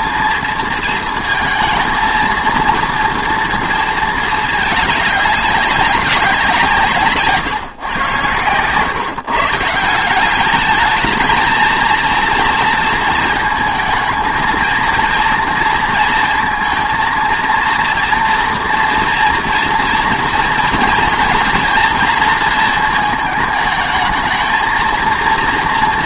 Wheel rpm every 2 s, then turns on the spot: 230, 230, 210, 170, 120, 210, 230, 230, 230, 230, 230, 230, 220.
none